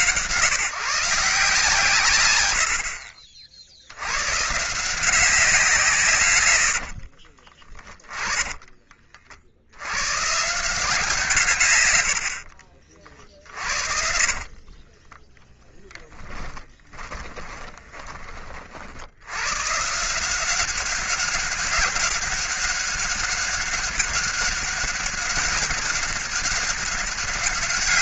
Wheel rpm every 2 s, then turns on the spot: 150, 60, 160, 60, 30, 160, 50, 20, 10, 60, 190, 190, 200, 200.
6-8 14-18